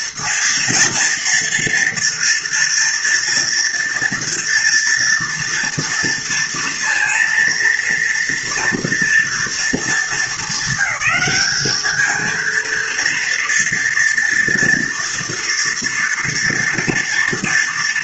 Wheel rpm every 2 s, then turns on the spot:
230, 240, 230, 230, 230, 220, 230, 230, 230.
none